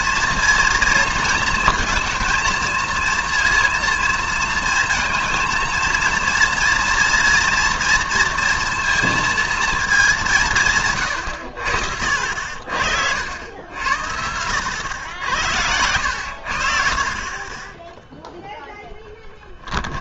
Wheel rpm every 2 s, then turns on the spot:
230, 230, 220, 230, 230, 150, 60, 90, 60, 0.
none